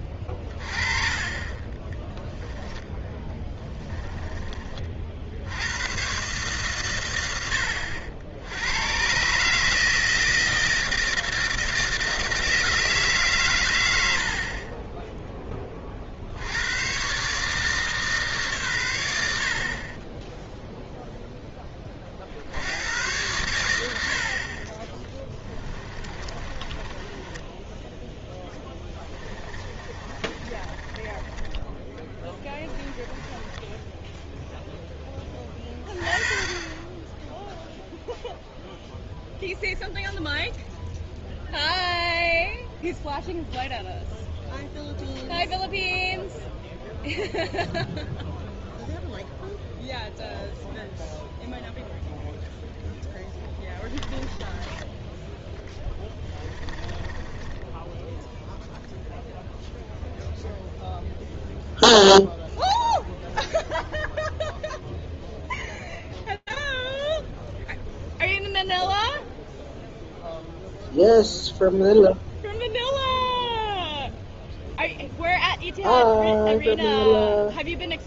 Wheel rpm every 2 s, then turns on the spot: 30, 10, 30, 130, 80, 160, 160, 40, 80, 130, 10, 70, 40, 30, 10, 30, 20, 0, 20, 0, 0, 0, 0, 0, 0, 0, 0, 10, 20, 0, 0, 0, 0, 0, 0, 0, 0, 0, 0.
0-4 26-34 54-58